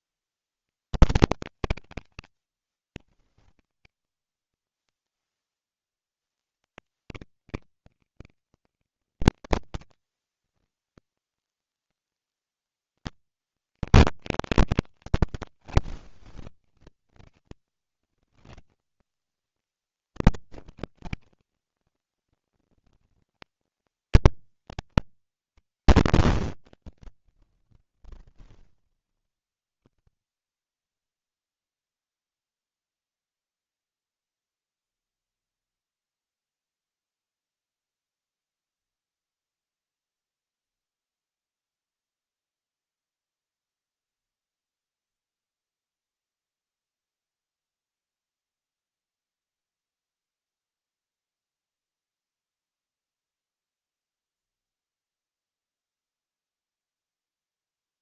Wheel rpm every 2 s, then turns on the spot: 80, 160, 120, 100, 190, 140, 170, 190, 150, 150, 150, 140, 170, 100, 10, 10, 0, 0, 0, 0, 0, 0, 0, 0, 0, 0, 0, 0, 0.
26-28